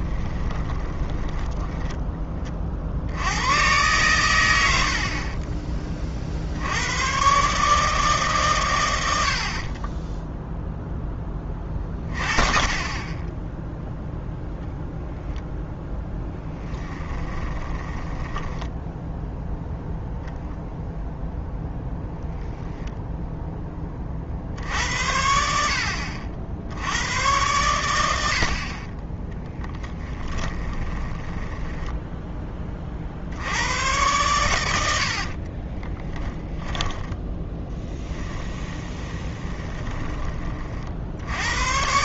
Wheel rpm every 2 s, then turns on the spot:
20, 50, 70, 90, 120, 0, 30, 0, 10, 10, 0, 0, 70, 80, 40, 20, 40, 80, 10, 20, 50.
0-2 4-6 16-20 30-32 36-40